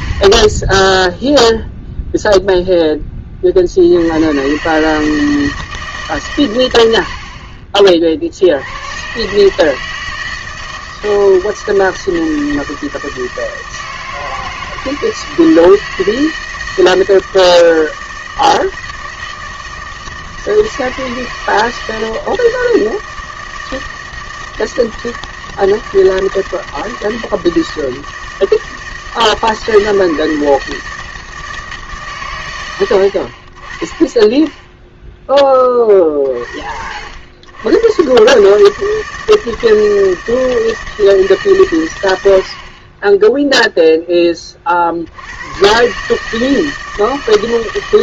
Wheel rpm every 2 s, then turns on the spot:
20, 10, 130, 110, 80, 160, 160, 160, 160, 160, 160, 160, 160, 160, 160, 160, 100, 10, 50, 150, 160, 50, 40, 160.
none